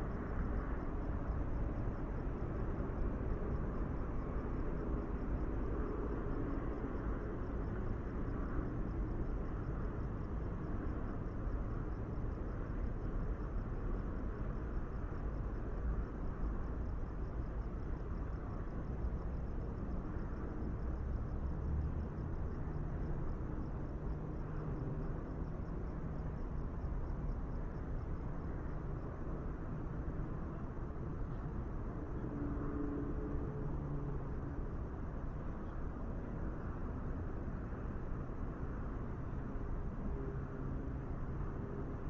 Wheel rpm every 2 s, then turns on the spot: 0, 0, 0, 0, 0, 0, 0, 0, 0, 0, 0, 0, 0, 0, 0, 0, 0, 0, 0, 0, 0.
none